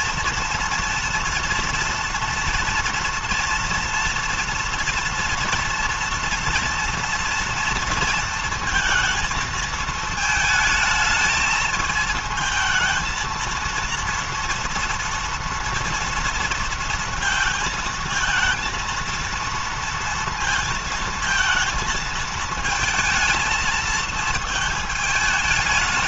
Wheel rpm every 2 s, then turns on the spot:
230, 240, 240, 230, 230, 220, 230, 230, 230, 230, 230, 220, 220.
none